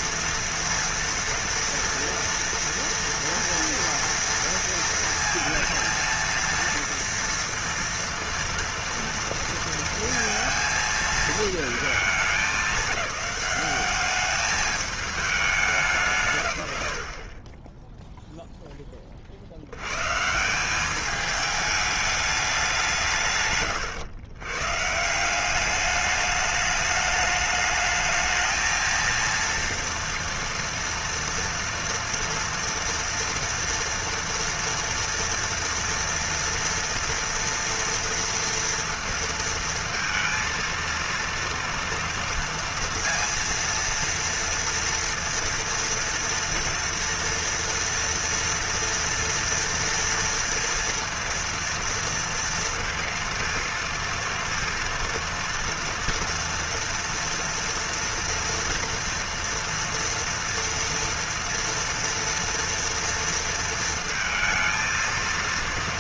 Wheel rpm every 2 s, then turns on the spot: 240, 230, 230, 230, 230, 230, 190, 210, 110, 10, 210, 180, 130, 210, 230, 230, 230, 240, 230, 230, 230, 230, 230, 230, 230, 230, 230, 230, 240, 230, 230, 230, 230.
none